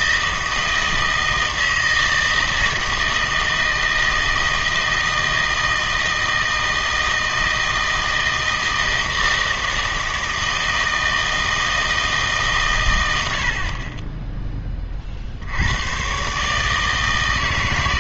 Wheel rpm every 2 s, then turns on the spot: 160, 160, 160, 160, 160, 160, 120, 20, 150.
none